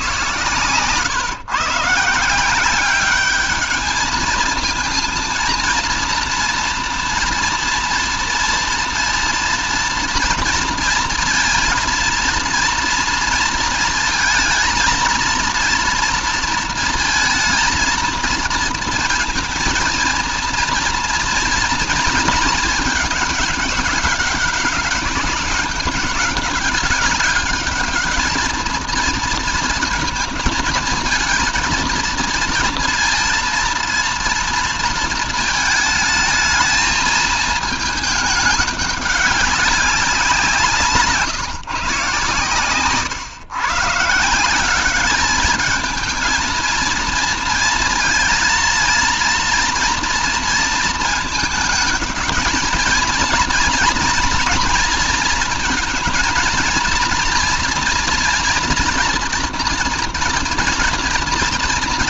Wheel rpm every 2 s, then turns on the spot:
130, 190, 230, 230, 230, 230, 230, 230, 230, 220, 230, 210, 200, 200, 220, 230, 230, 230, 220, 200, 170, 130, 190, 220, 230, 230, 220, 230, 230, 230, 230.
none